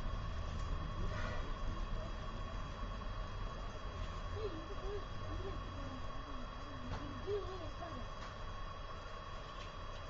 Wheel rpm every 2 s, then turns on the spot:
0, 0, 0, 0, 0.
none